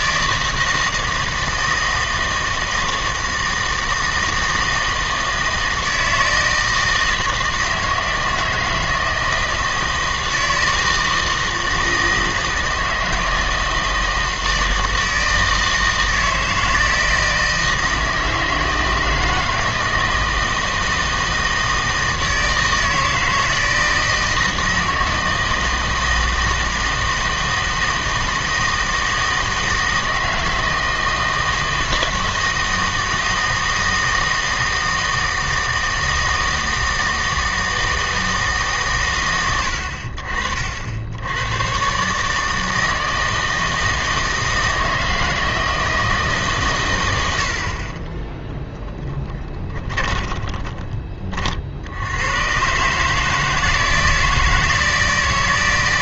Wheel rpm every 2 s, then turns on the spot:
160, 160, 160, 160, 160, 160, 160, 160, 160, 160, 160, 160, 160, 160, 160, 160, 160, 160, 160, 150, 70, 160, 160, 120, 10, 20, 130, 160.
48-52